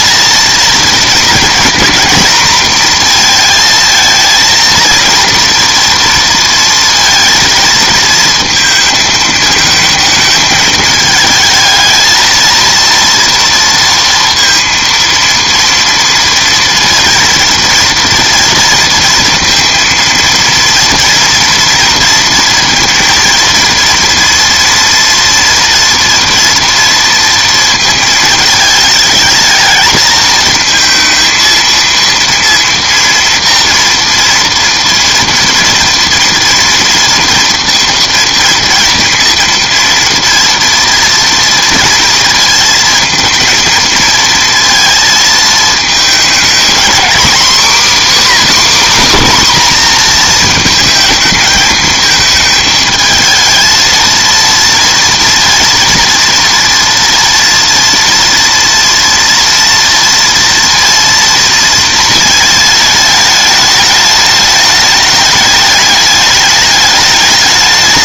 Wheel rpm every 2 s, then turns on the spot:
230, 240, 230, 230, 230, 220, 230, 230, 230, 230, 230, 230, 240, 230, 220, 220, 230, 230, 230, 230, 230, 230, 230, 230, 290, 230, 220, 230, 230, 230, 230, 220, 210, 210.
none